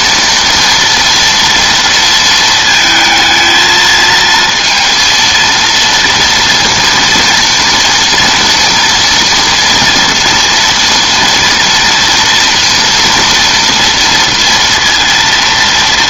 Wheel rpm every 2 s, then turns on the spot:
230, 220, 230, 230, 230, 230, 230, 230.
none